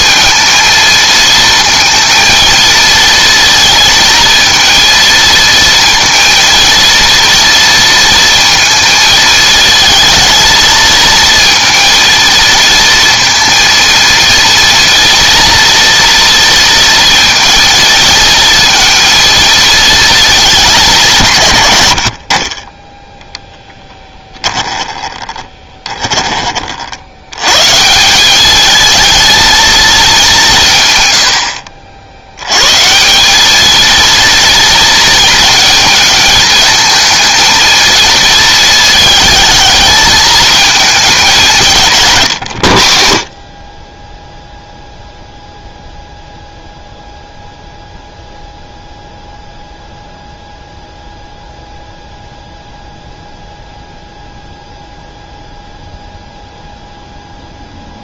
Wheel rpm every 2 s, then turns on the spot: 230, 230, 220, 230, 230, 220, 230, 230, 230, 230, 190, 20, 10, 50, 220, 140, 130, 230, 230, 220, 220, 70, 0, 0, 0, 0, 0, 0, 0.
24-26